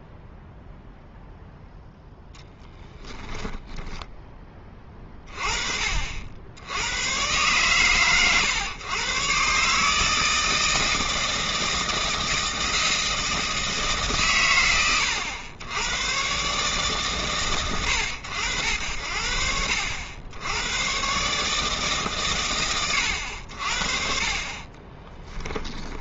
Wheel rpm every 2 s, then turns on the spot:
0, 10, 10, 70, 120, 160, 160, 110, 130, 90, 90, 120, 40.
none